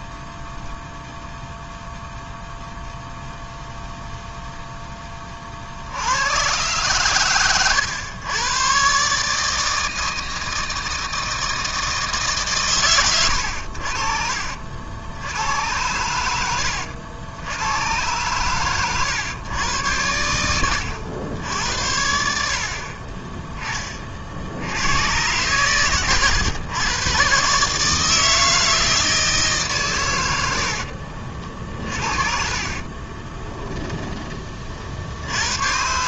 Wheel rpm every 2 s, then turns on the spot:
0, 0, 10, 120, 130, 160, 120, 80, 80, 110, 90, 50, 100, 110, 160, 60, 40, 60.
30-34